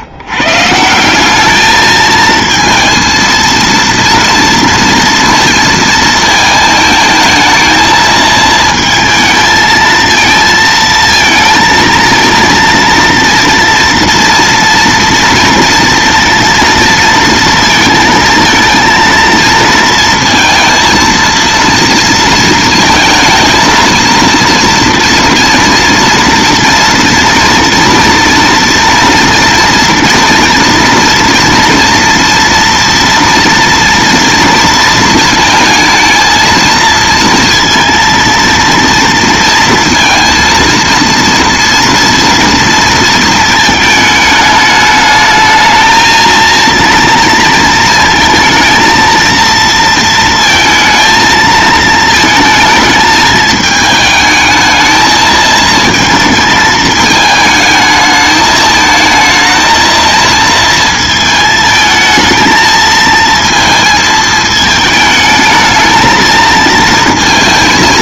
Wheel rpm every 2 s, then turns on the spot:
180, 230, 230, 220, 220, 230, 230, 230, 230, 230, 230, 230, 230, 230, 230, 230, 230, 230, 230, 230, 230, 230, 210, 230, 230, 220, 220, 220, 220, 220, 220, 230, 220, 230.
none